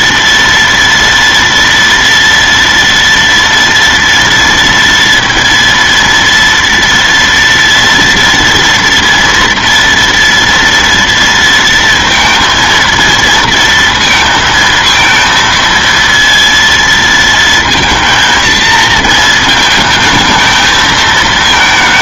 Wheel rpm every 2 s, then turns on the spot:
230, 230, 230, 230, 230, 230, 230, 230, 230, 230, 220.
none